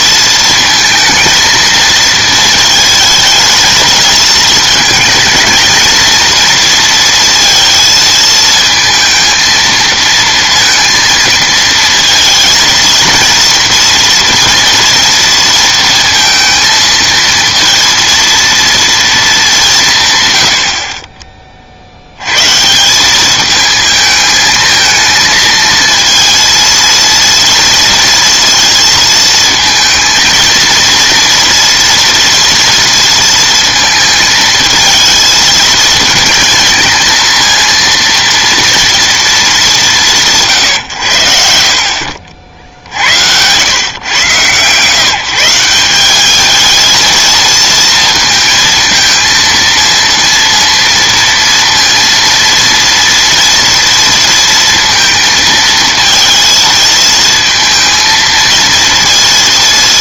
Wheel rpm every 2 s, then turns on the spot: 230, 220, 220, 230, 230, 230, 230, 230, 220, 230, 50, 170, 220, 230, 230, 230, 230, 220, 230, 230, 120, 60, 150, 220, 230, 230, 230, 230, 230, 230.
none